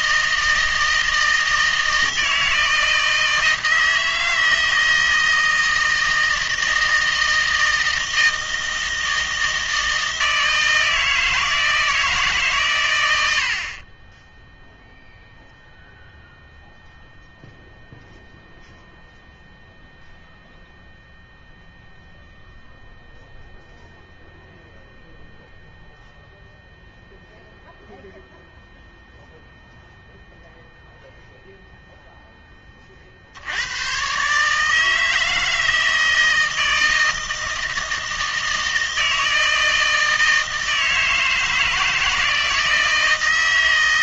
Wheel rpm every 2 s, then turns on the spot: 160, 160, 160, 160, 160, 160, 130, 0, 0, 0, 0, 0, 0, 0, 0, 0, 20, 150, 160, 160, 160, 160.
none